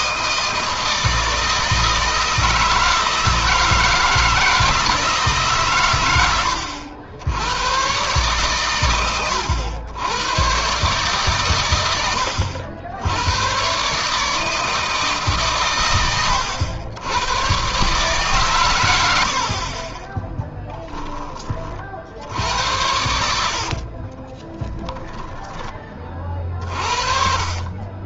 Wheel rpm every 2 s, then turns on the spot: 160, 160, 160, 80, 110, 130, 90, 150, 90, 110, 10, 80, 10, 30.
24-26